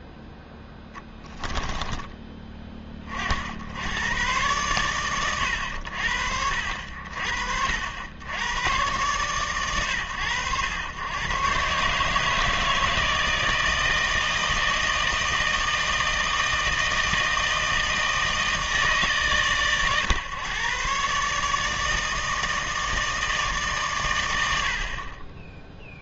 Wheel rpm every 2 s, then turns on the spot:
0, 30, 110, 60, 100, 110, 150, 160, 160, 140, 140, 160, 50.
none